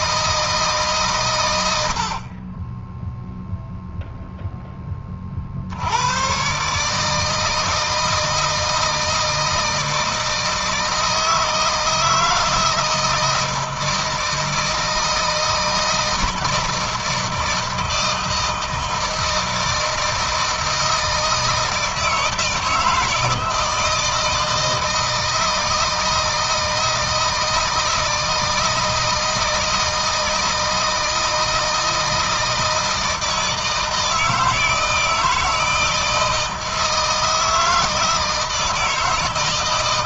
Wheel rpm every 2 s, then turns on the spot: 140, 10, 20, 140, 160, 160, 160, 160, 160, 160, 160, 160, 160, 160, 160, 160, 160, 160, 160, 160.
none